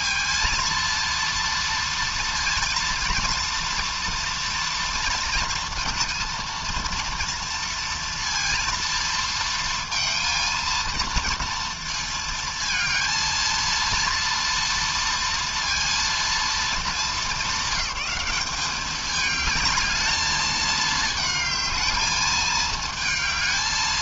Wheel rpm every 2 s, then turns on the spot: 230, 230, 230, 230, 230, 230, 230, 230, 230, 210, 220, 220.
none